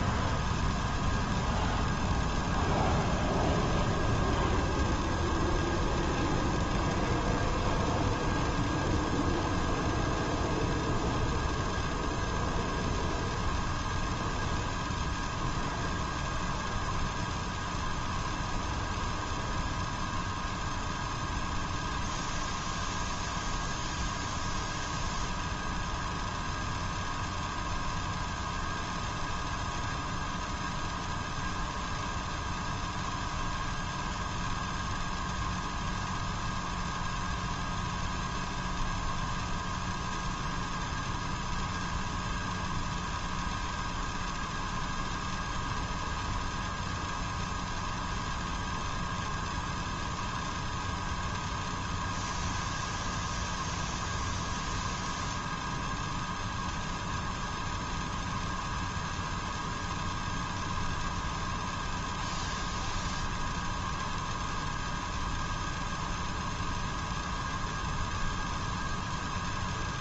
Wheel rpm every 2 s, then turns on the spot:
0, 0, 0, 0, 0, 0, 0, 0, 0, 0, 0, 0, 0, 0, 0, 0, 0, 0, 0, 0, 0, 0, 0, 0, 0, 0, 0, 0, 0, 0, 0, 0, 0, 0, 0.
none